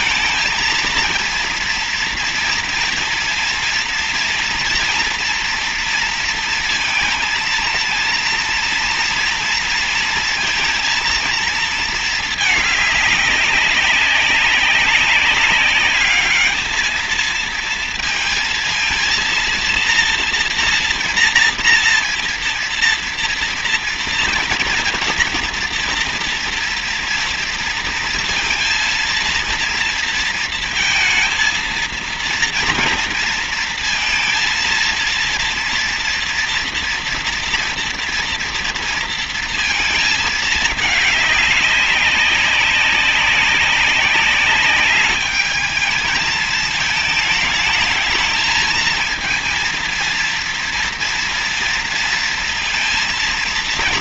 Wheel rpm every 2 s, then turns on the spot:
230, 230, 230, 230, 230, 230, 210, 200, 220, 230, 240, 230, 230, 230, 230, 230, 230, 230, 230, 230, 220, 200, 200, 220, 220, 230, 230.
none